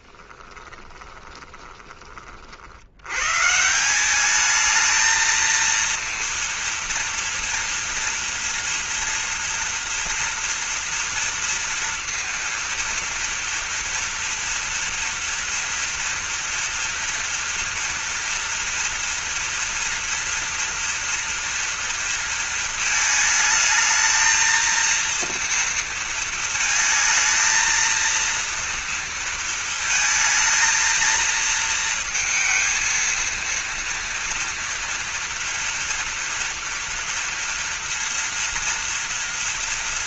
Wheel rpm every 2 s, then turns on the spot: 20, 60, 220, 230, 230, 230, 230, 230, 230, 230, 230, 220, 230, 220, 230, 230, 220, 230, 230, 230.
0-2